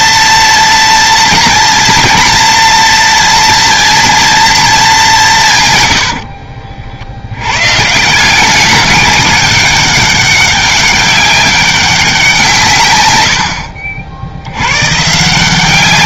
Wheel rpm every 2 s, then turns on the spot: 240, 230, 210, 50, 200, 190, 120, 120.
none